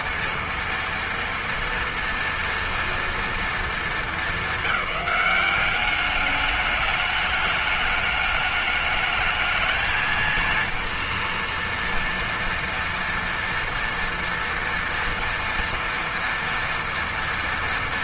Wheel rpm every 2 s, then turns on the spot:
240, 190, 210, 210, 230, 230, 230, 230, 240.
none